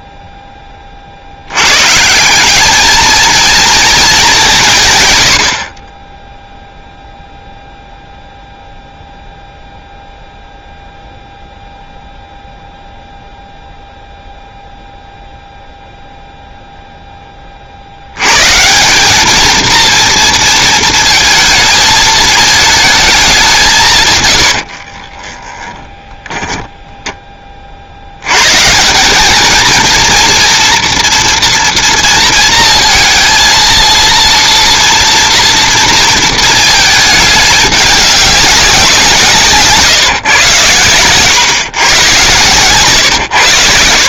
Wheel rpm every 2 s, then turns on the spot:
70, 220, 100, 0, 0, 0, 0, 0, 10, 220, 230, 200, 20, 10, 180, 240, 230, 230, 210, 170, 120, 130.
24-26